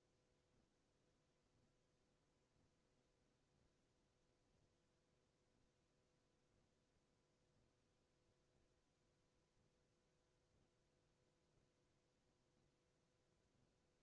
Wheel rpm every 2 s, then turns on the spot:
0, 0, 0, 0, 0, 0, 0.
none